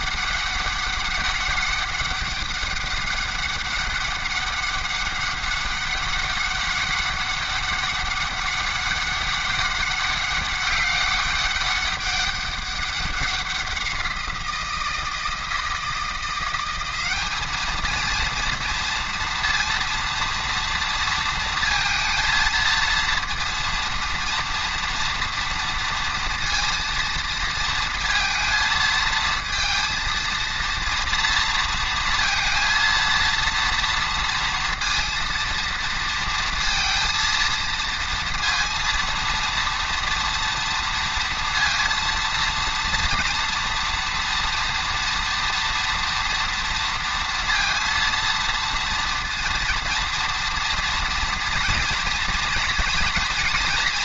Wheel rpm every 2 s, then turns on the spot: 200, 200, 200, 200, 200, 200, 200, 170, 190, 230, 230, 230, 230, 230, 220, 230, 230, 230, 230, 230, 230, 230, 230, 230, 230, 230, 230.
none